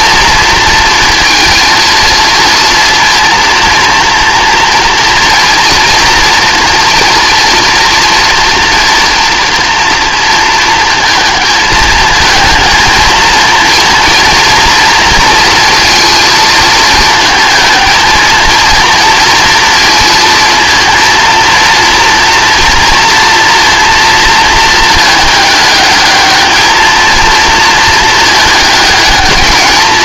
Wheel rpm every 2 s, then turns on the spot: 230, 230, 240, 240, 230, 230, 220, 230, 220, 230, 230, 230, 220, 220, 210.
none